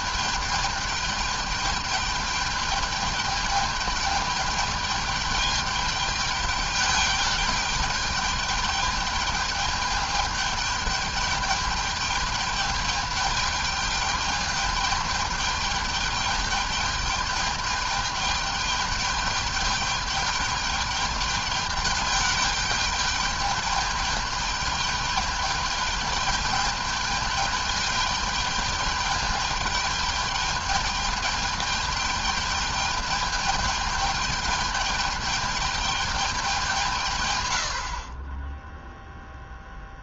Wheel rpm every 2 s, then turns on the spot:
210, 210, 210, 210, 210, 210, 210, 210, 210, 210, 210, 210, 210, 210, 210, 210, 210, 210, 190, 20.
none